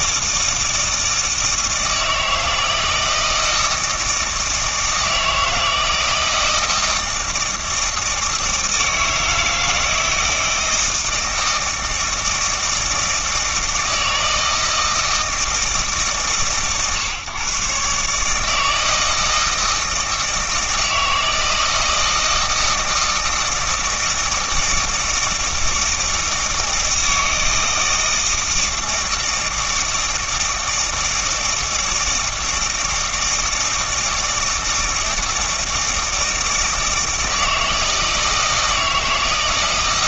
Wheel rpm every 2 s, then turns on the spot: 160, 160, 160, 160, 160, 160, 160, 160, 110, 160, 160, 160, 160, 160, 160, 160, 160, 160, 160, 160.
none